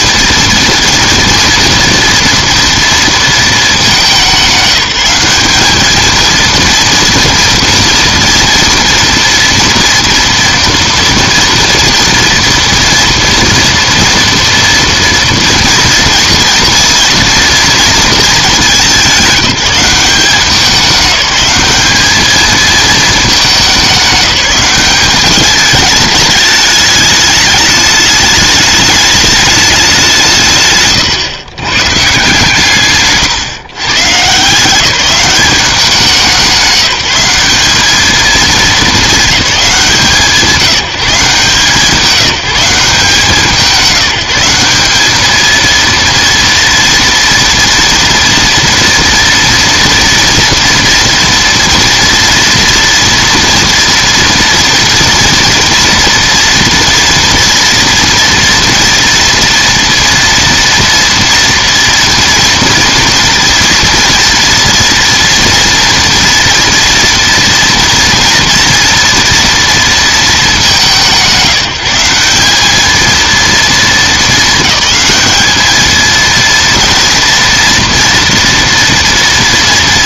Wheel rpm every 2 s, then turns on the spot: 230, 230, 190, 230, 230, 230, 230, 230, 230, 200, 180, 220, 200, 210, 210, 150, 140, 170, 190, 220, 180, 170, 190, 230, 230, 230, 230, 230, 240, 230, 230, 230, 240, 230, 230, 190, 200, 210, 230, 230.
none